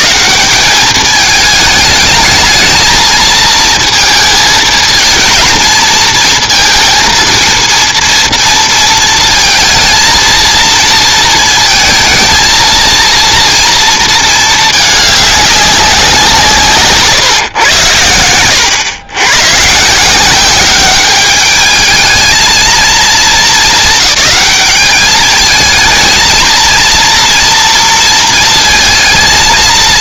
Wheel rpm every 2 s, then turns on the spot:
120, 220, 220, 230, 230, 230, 230, 220, 160, 100, 190, 220, 210, 230, 230.
none